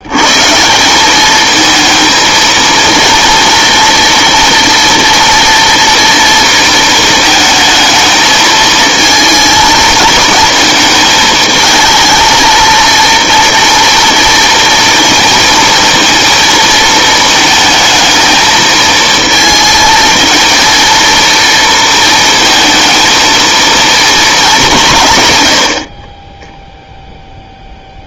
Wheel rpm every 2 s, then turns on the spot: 160, 230, 230, 230, 220, 230, 230, 230, 230, 220, 230, 230, 200, 0.
none